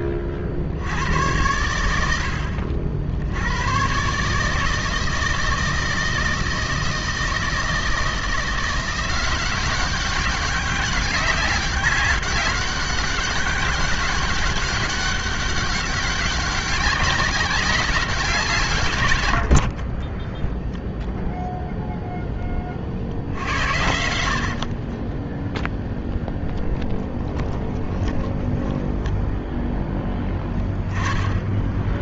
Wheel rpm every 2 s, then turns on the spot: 60, 70, 150, 160, 170, 200, 190, 190, 190, 170, 10, 10, 60, 0, 10, 10.
20-22 28-30